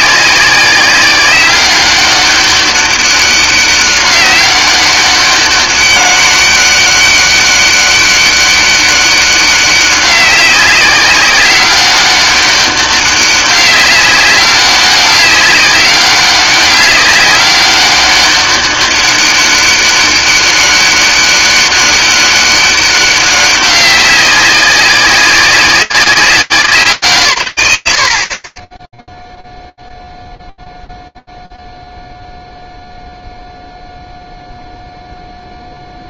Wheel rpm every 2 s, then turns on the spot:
190, 200, 190, 200, 200, 190, 200, 200, 200, 200, 200, 200, 190, 180, 30, 0, 0, 0.
none